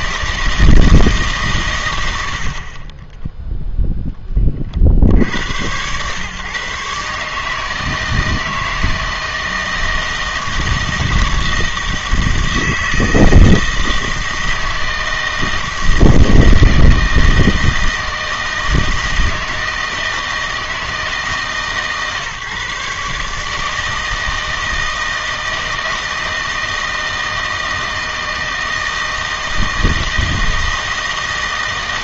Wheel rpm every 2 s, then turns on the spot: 160, 50, 30, 130, 160, 160, 160, 160, 160, 160, 160, 140, 160, 160, 160, 160.
none